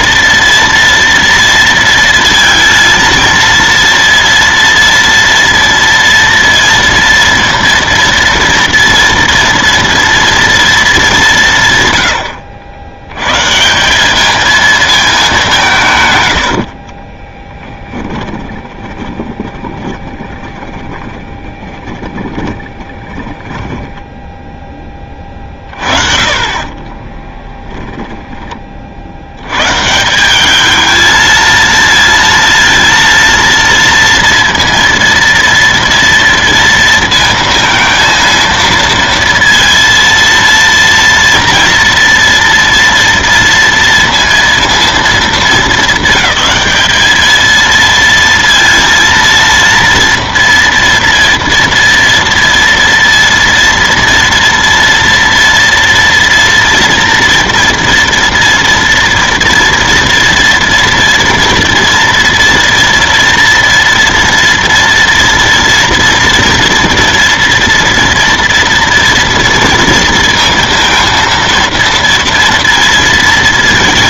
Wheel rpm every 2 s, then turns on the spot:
230, 230, 230, 230, 230, 230, 80, 220, 80, 20, 20, 10, 10, 30, 20, 200, 230, 230, 230, 230, 230, 230, 230, 200, 230, 230, 230, 230, 230, 230, 230, 230, 230, 230, 230, 230, 230.
16-24 26-28